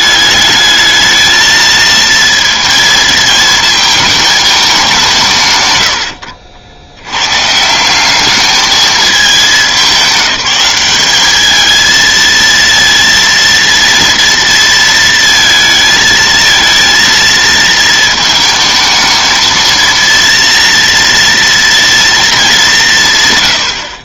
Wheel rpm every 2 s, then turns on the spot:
210, 230, 170, 90, 210, 200, 230, 230, 230, 220, 230, 200.
none